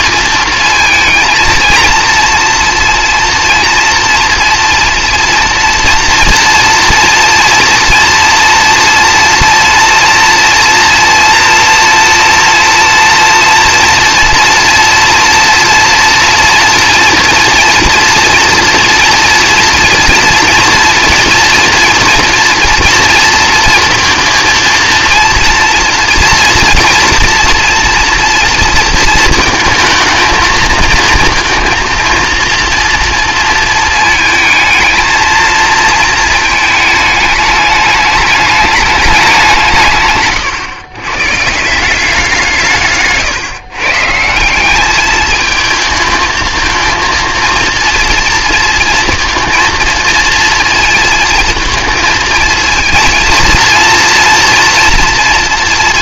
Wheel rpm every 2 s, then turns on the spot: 230, 230, 230, 230, 230, 240, 230, 240, 230, 240, 230, 230, 230, 240, 230, 220, 230, 220, 220, 210, 120, 160, 190, 230, 230, 230, 220, 230.
none